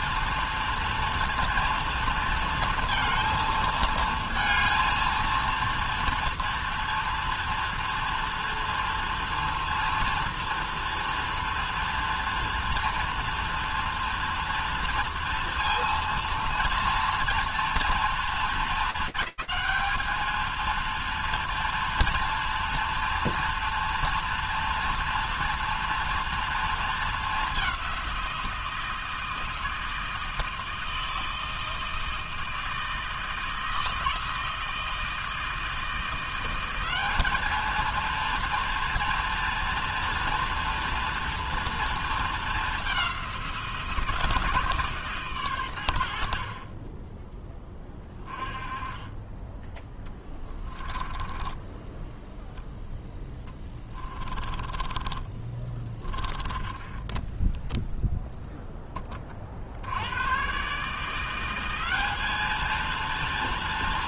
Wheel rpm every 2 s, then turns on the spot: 230, 230, 230, 230, 230, 230, 230, 230, 230, 200, 230, 230, 230, 220, 160, 160, 160, 160, 200, 230, 230, 200, 150, 20, 20, 10, 0, 20, 20, 10, 150, 230.
50-52 54-58